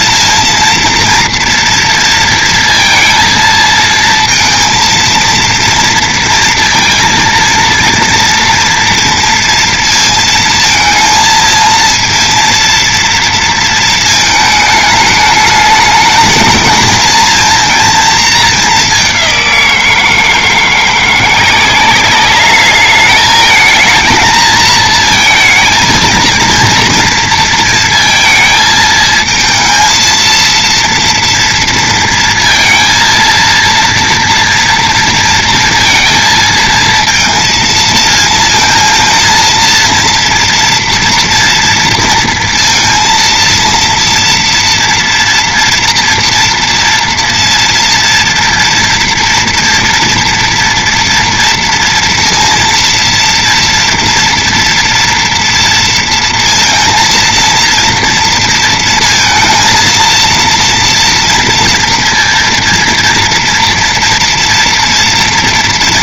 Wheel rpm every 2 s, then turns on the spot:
230, 230, 230, 230, 230, 230, 230, 220, 220, 210, 170, 210, 230, 230, 220, 230, 230, 230, 230, 230, 230, 230, 230, 230, 230, 230, 230, 230, 230, 230, 230, 230, 230.
none